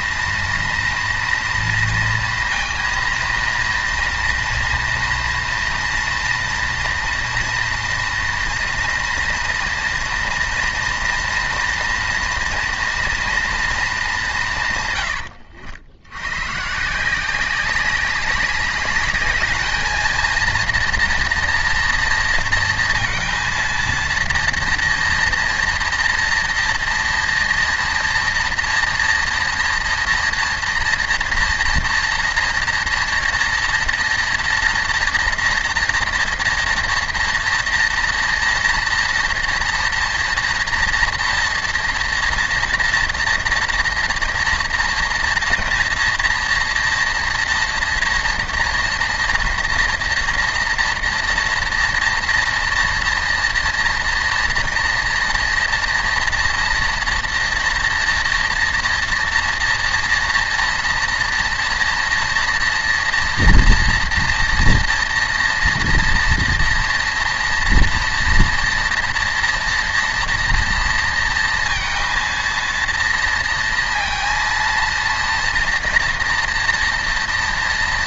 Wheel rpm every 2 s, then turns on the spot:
240, 230, 230, 230, 230, 230, 230, 140, 140, 200, 230, 230, 230, 230, 230, 230, 240, 230, 240, 230, 230, 230, 230, 230, 230, 230, 230, 230, 230, 230, 230, 230, 230, 230, 230, 230, 230, 230, 230.
none